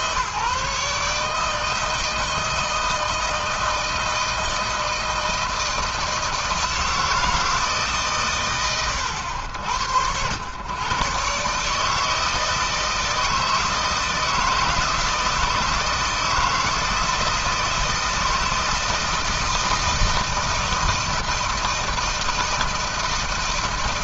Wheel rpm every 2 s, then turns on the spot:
150, 160, 160, 160, 90, 130, 160, 160, 160, 160, 160, 160.
none